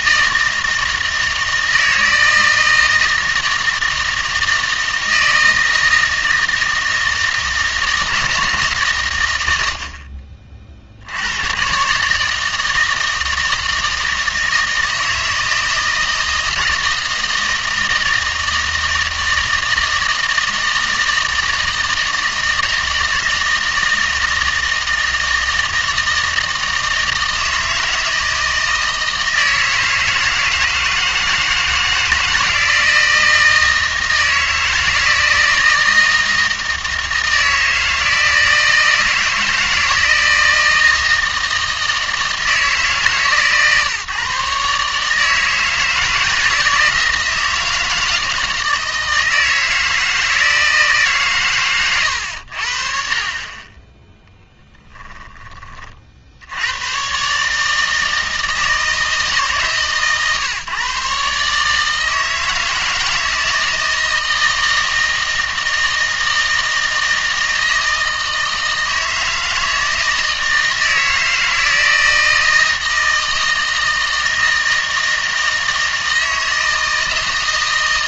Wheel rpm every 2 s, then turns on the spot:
160, 160, 160, 160, 140, 50, 160, 160, 160, 160, 160, 160, 160, 160, 160, 160, 160, 160, 160, 160, 160, 150, 150, 160, 160, 160, 60, 10, 120, 160, 140, 160, 160, 160, 160, 160, 160, 160, 160.
none